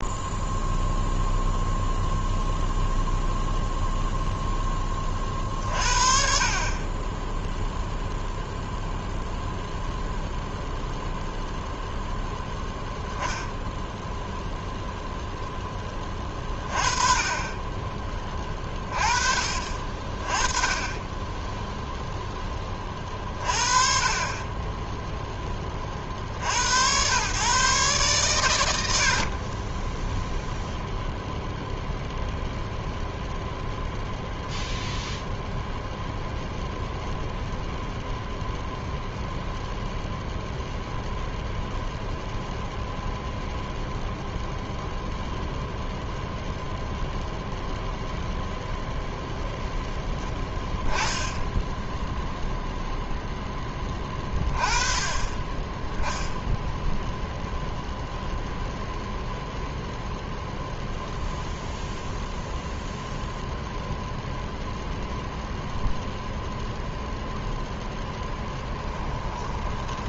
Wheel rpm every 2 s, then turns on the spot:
0, 0, 20, 20, 0, 0, 10, 0, 20, 20, 10, 30, 10, 90, 90, 0, 0, 0, 0, 0, 0, 0, 0, 0, 0, 0, 0, 20, 0, 0, 0, 0, 0, 0, 10.
68-70